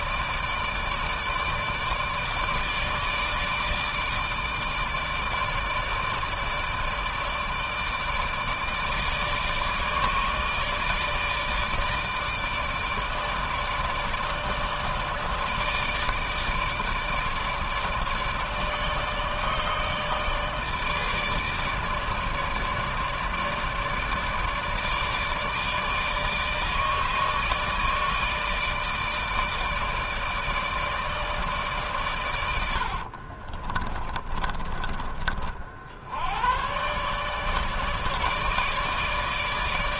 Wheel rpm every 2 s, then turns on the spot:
150, 150, 150, 150, 160, 150, 150, 150, 160, 150, 150, 150, 150, 160, 160, 150, 60, 30, 130, 150.
32-34